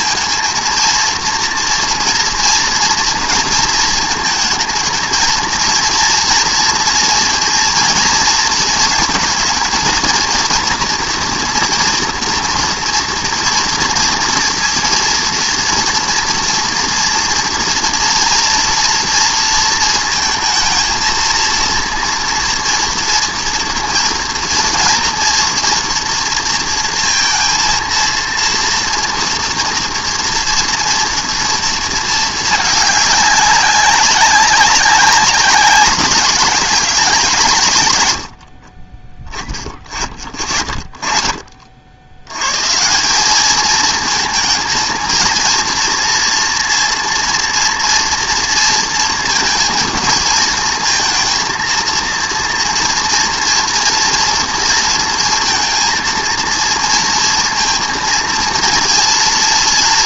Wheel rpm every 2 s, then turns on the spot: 230, 230, 220, 230, 230, 230, 230, 230, 230, 230, 220, 230, 230, 230, 230, 230, 210, 190, 200, 30, 40, 150, 220, 230, 230, 220, 230, 230, 230, 230.
none